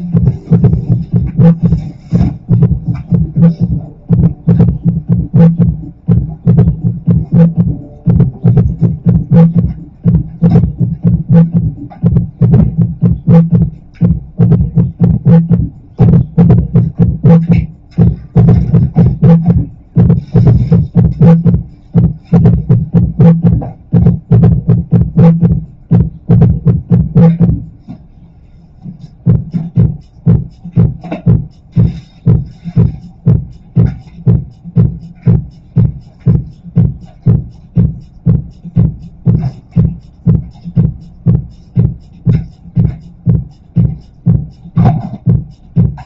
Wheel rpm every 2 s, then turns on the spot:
0, 0, 0, 0, 0, 0, 0, 0, 0, 0, 0, 0, 0, 0, 0, 0, 0, 0, 0, 0, 0, 0, 0.
none